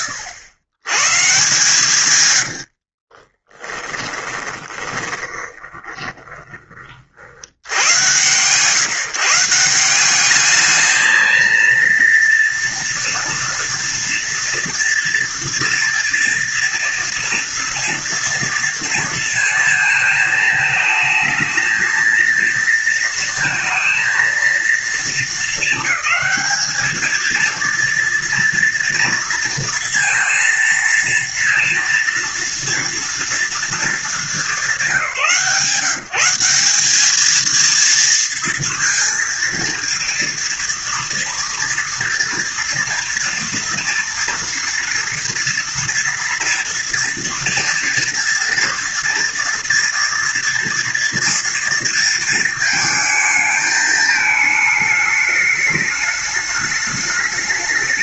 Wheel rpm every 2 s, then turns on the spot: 100, 70, 20, 50, 140, 220, 230, 230, 230, 230, 220, 230, 230, 220, 230, 230, 230, 190, 200, 230, 230, 230, 230, 240, 230, 230, 220, 220, 210.
2-6